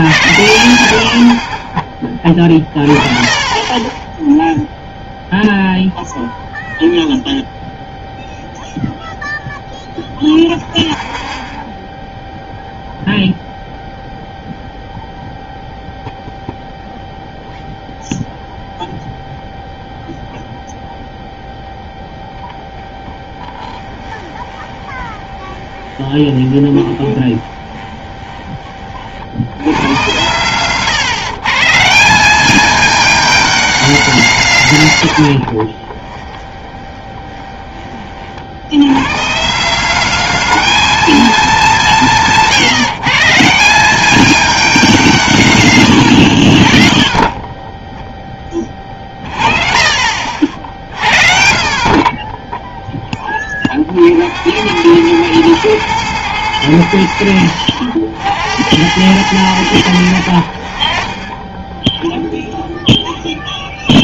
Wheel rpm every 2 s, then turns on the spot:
90, 40, 0, 0, 0, 0, 0, 0, 0, 0, 0, 20, 20, 20, 30, 130, 210, 160, 20, 80, 210, 160, 230, 60, 20, 60, 10, 80, 100, 80, 60, 0.
2-4 22-28 36-38